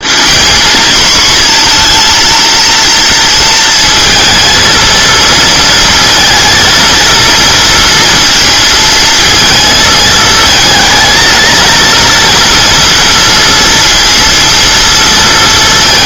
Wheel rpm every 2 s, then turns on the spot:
230, 230, 220, 230, 230, 220, 230, 230.
none